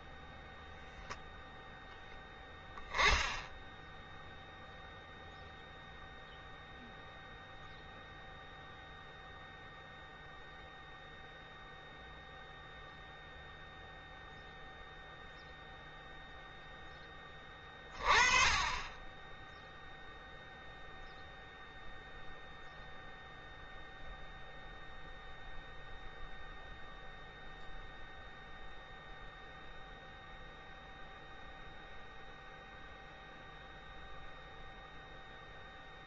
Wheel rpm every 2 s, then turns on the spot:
0, 10, 0, 0, 0, 0, 0, 0, 0, 10, 0, 0, 0, 0, 0, 0, 0, 0.
none